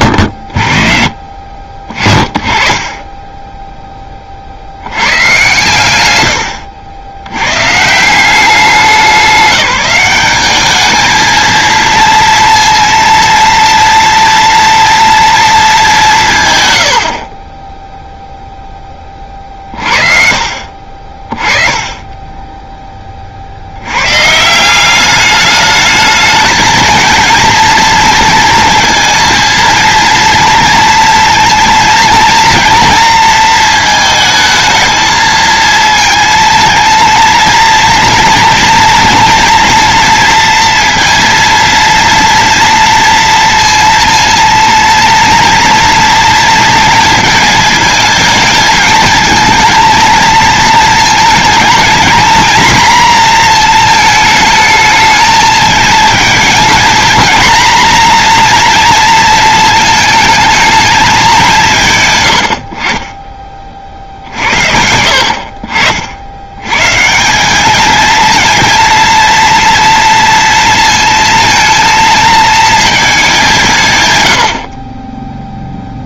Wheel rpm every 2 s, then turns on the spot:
50, 20, 80, 80, 190, 210, 230, 230, 110, 0, 50, 10, 180, 230, 230, 230, 230, 220, 230, 230, 230, 230, 230, 230, 220, 220, 240, 220, 230, 240, 220, 60, 60, 120, 230, 230, 220, 50.
20-22